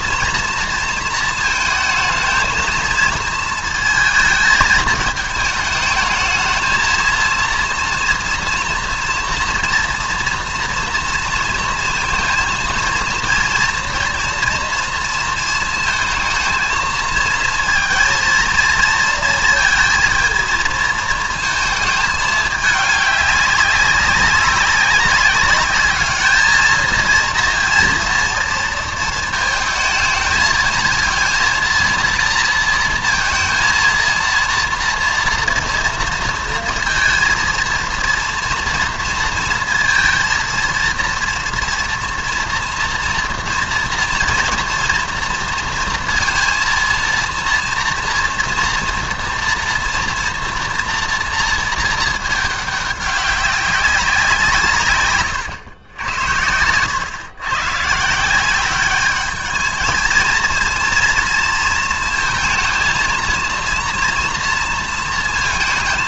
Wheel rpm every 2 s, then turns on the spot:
230, 220, 220, 220, 230, 230, 230, 230, 220, 230, 220, 210, 190, 220, 220, 220, 230, 230, 230, 230, 230, 230, 230, 230, 230, 230, 200, 150, 100, 200, 230, 230, 230.
none